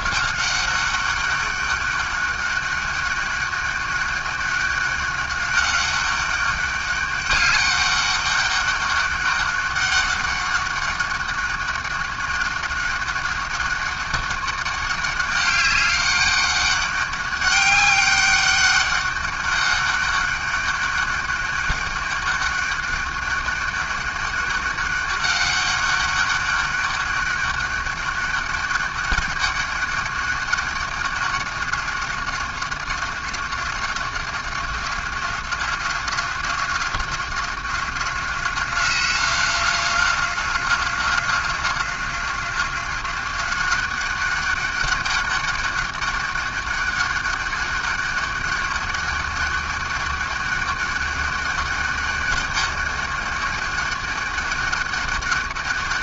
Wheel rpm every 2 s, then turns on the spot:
190, 200, 200, 200, 200, 200, 200, 200, 200, 200, 200, 200, 200, 200, 200, 200, 190, 190, 190, 190, 190, 190, 200, 200, 200, 200, 200, 200.
none